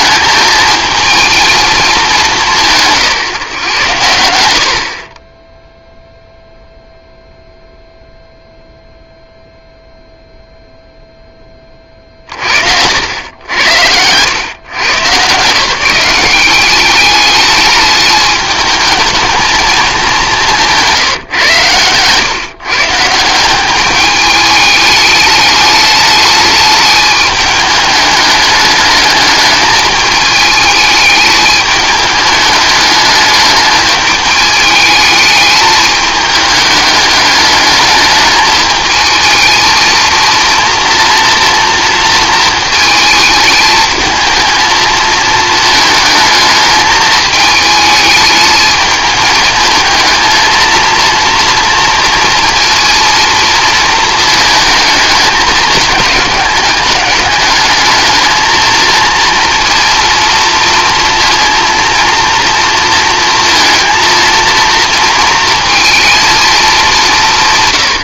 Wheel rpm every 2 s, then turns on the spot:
220, 170, 70, 0, 0, 0, 60, 120, 190, 210, 170, 140, 210, 210, 210, 210, 210, 210, 210, 220, 230, 220, 230, 220, 210, 230, 230, 220, 200, 220, 230, 230, 230, 220.
20-22